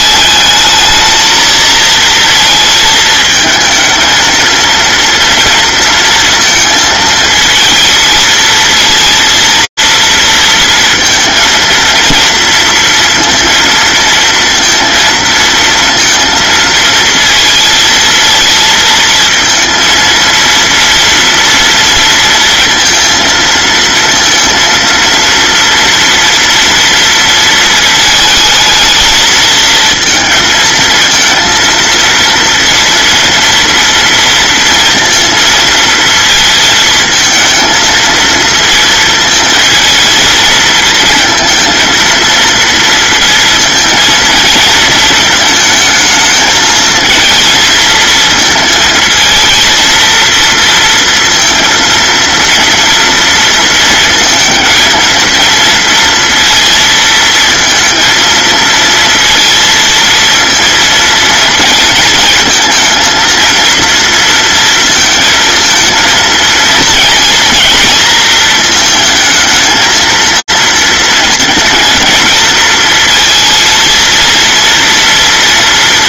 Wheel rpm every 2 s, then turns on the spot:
220, 220, 230, 230, 230, 230, 230, 230, 220, 220, 240, 230, 230, 230, 220, 230, 230, 230, 220, 230, 220, 230, 230, 220, 220, 230, 230, 230, 230, 230, 230, 230, 230, 230, 220, 230, 230, 230.
none